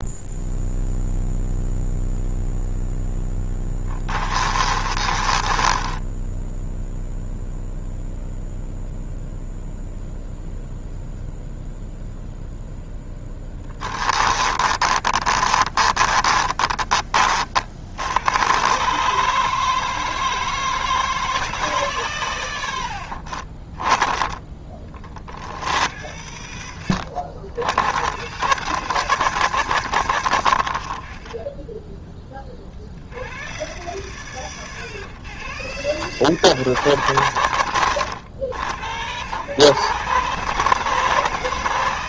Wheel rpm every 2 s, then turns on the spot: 0, 0, 20, 0, 0, 0, 0, 30, 40, 140, 160, 70, 30, 80, 160, 40, 70, 100, 130, 110, 160.
4-6 14-18 22-24